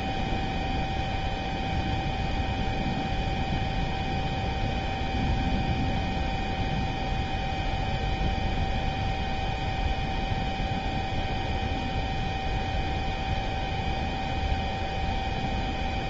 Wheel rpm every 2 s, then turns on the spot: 0, 0, 0, 0, 0, 0, 0, 0.
none